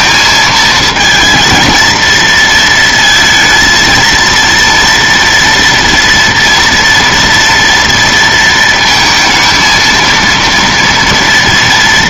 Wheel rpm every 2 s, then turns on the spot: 220, 230, 230, 230, 230, 230.
none